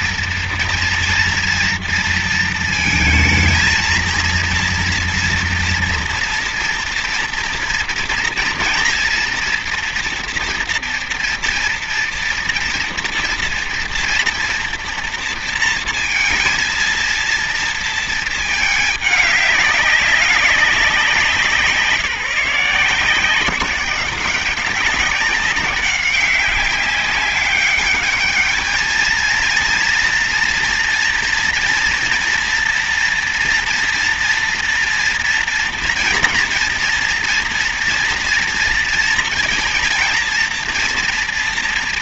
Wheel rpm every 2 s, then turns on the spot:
240, 230, 230, 230, 230, 230, 230, 230, 230, 210, 190, 160, 190, 200, 220, 240, 230, 230, 230, 240, 230.
none